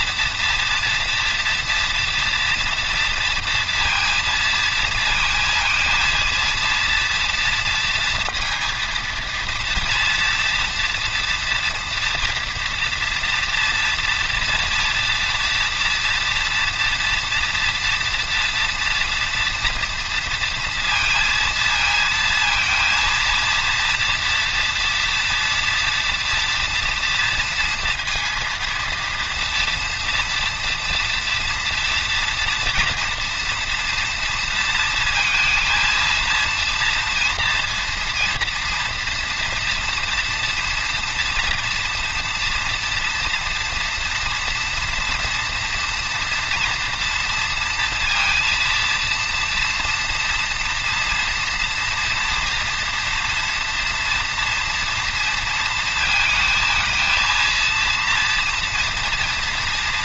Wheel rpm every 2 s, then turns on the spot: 240, 230, 220, 230, 230, 230, 240, 230, 240, 230, 230, 230, 240, 230, 230, 240, 240, 230, 230, 230, 230, 240, 230, 230, 230, 230, 230, 230, 230, 230.
none